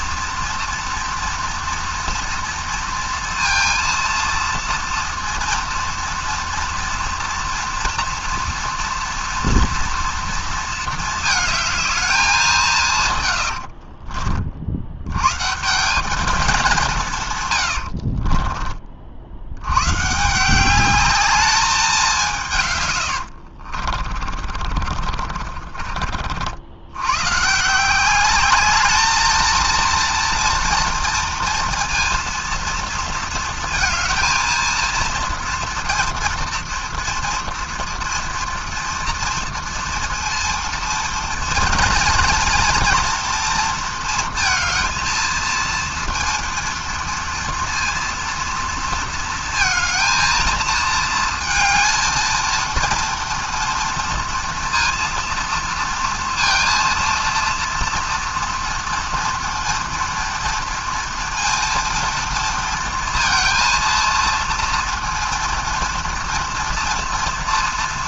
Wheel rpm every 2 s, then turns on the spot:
230, 230, 230, 230, 230, 220, 160, 80, 190, 40, 190, 120, 40, 90, 210, 230, 230, 230, 230, 230, 230, 230, 230, 230, 230, 220, 230, 230, 230, 230, 230, 230, 230, 230.
24-26